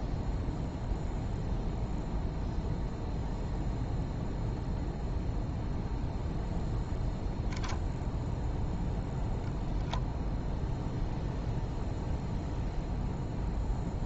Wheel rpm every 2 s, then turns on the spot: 0, 0, 0, 0, 0, 0, 0.
none